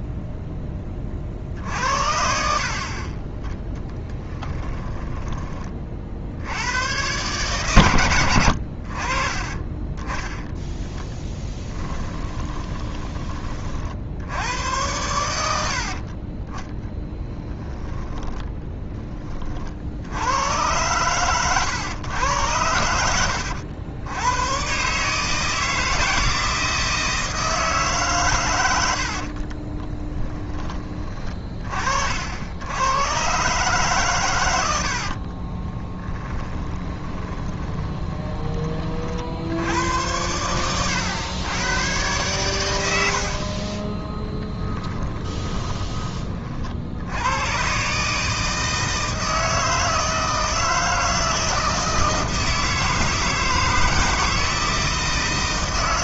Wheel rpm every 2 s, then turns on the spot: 10, 50, 10, 100, 70, 10, 20, 90, 20, 10, 110, 100, 130, 160, 90, 10, 80, 90, 30, 20, 100, 100, 20, 60, 160, 160, 160, 160.
10-14 16-18 28-30 34-38 44-46